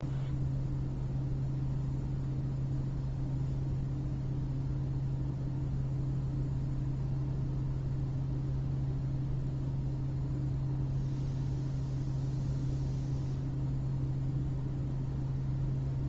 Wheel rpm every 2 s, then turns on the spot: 0, 0, 0, 0, 0, 0, 0, 0.
none